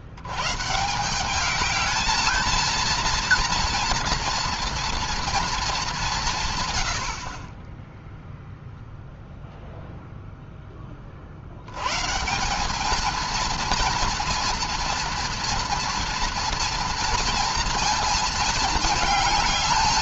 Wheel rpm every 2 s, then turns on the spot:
120, 220, 230, 150, 0, 10, 180, 230, 230, 220.
none